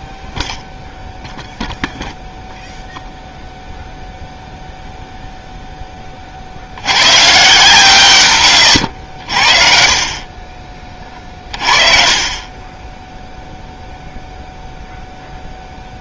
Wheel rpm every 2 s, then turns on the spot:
0, 0, 0, 120, 70, 30, 0, 0.
none